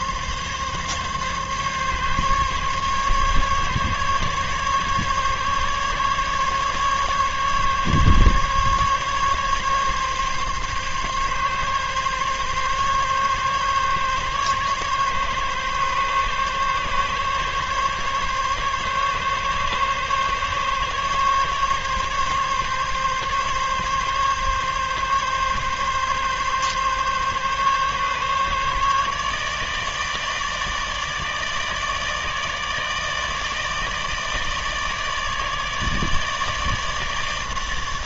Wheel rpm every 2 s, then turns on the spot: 140, 140, 140, 140, 140, 140, 140, 140, 140, 140, 140, 140, 140, 140, 150, 150, 150, 150, 150.
none